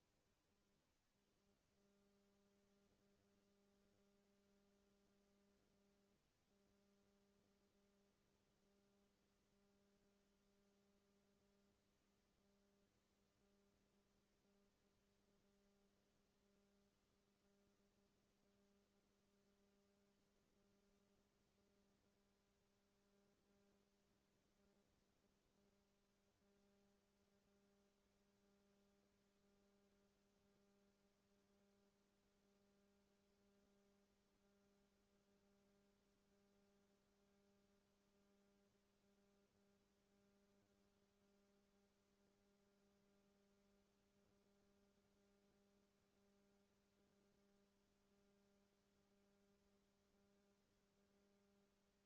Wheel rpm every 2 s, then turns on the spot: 0, 0, 0, 0, 0, 0, 0, 0, 0, 0, 0, 0, 0, 0, 0, 0, 0, 0, 0, 0, 0, 0, 0, 0, 0, 0.
none